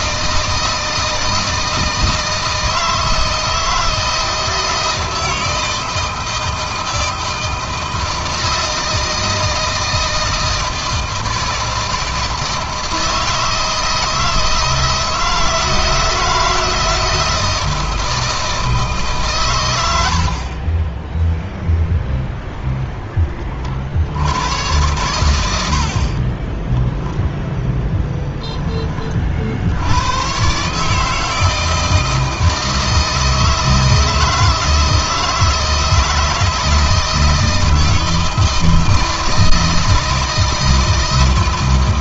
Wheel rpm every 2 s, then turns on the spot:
160, 160, 160, 160, 160, 160, 160, 160, 160, 160, 30, 10, 110, 10, 20, 140, 160, 160, 160, 160, 160.
26-28